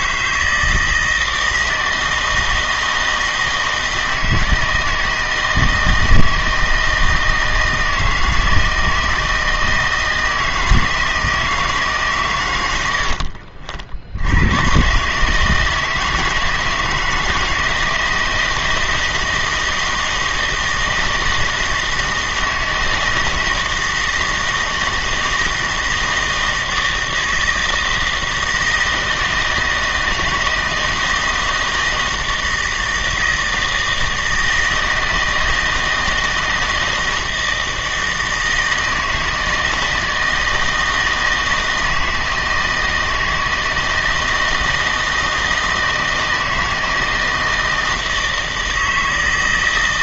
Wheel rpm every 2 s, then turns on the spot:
160, 160, 160, 160, 160, 160, 100, 120, 160, 160, 160, 160, 160, 160, 160, 160, 160, 160, 160, 160, 160, 160, 160, 160, 160.
none